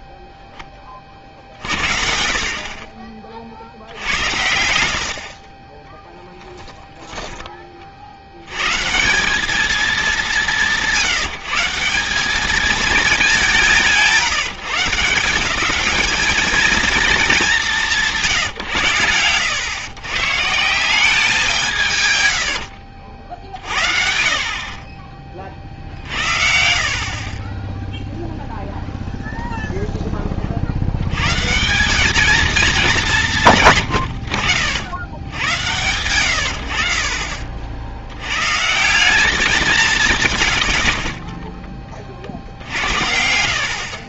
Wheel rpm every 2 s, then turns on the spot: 20, 40, 80, 10, 130, 180, 220, 170, 230, 120, 180, 80, 40, 50, 0, 70, 220, 90, 60, 150, 60, 60.
4-8 22-26